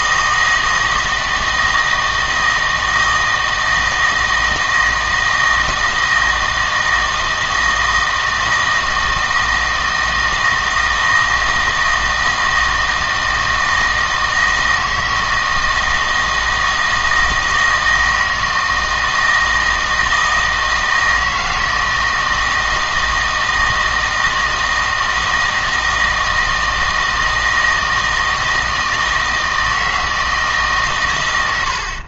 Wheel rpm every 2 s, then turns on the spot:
160, 160, 160, 160, 160, 160, 160, 160, 160, 160, 160, 160, 160, 160, 160, 150.
none